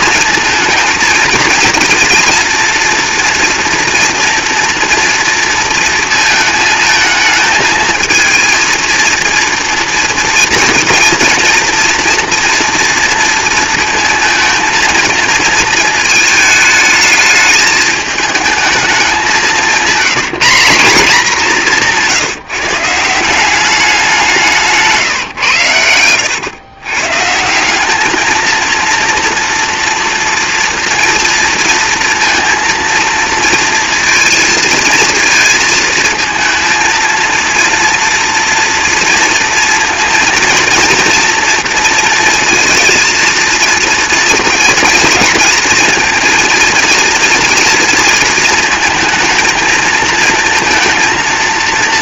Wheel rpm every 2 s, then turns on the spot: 230, 230, 230, 220, 230, 230, 230, 220, 220, 220, 190, 160, 170, 120, 230, 230, 230, 220, 230, 230, 230, 230, 230, 230, 230, 230.
none